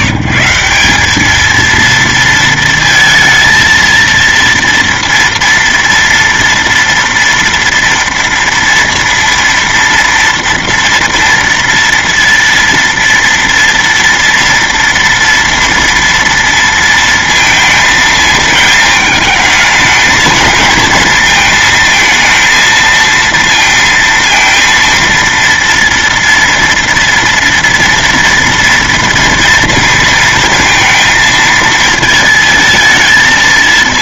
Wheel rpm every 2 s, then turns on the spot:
170, 230, 230, 240, 230, 230, 230, 230, 230, 220, 220, 230, 230, 230, 230, 220, 220.
none